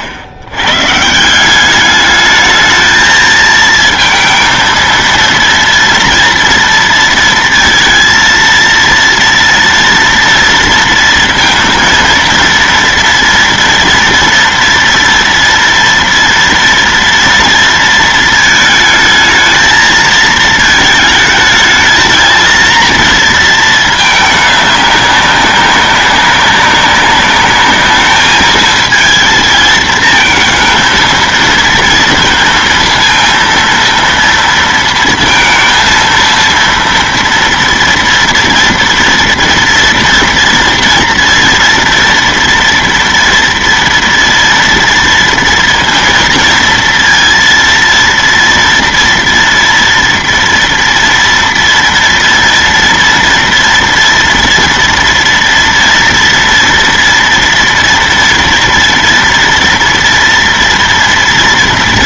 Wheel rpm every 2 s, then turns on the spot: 100, 220, 230, 230, 230, 230, 230, 230, 230, 220, 220, 230, 210, 200, 220, 220, 230, 230, 230, 230, 230, 230, 230, 230, 230, 230, 230, 240, 230, 230, 230.
none